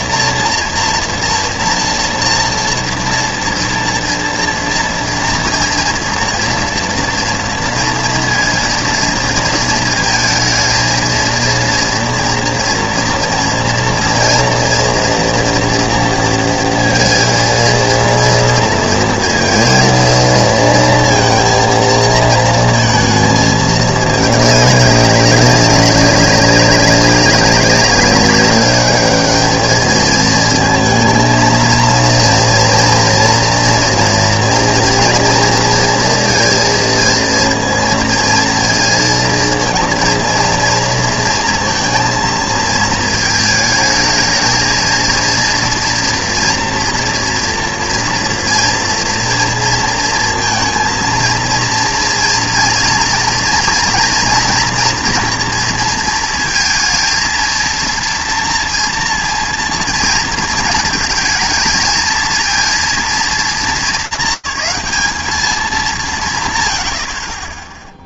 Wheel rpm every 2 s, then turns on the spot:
240, 240, 230, 230, 230, 230, 230, 230, 230, 230, 230, 230, 200, 190, 210, 230, 230, 230, 230, 230, 230, 230, 230, 240, 240, 230, 230, 230, 230, 230, 230, 230, 200, 140.
none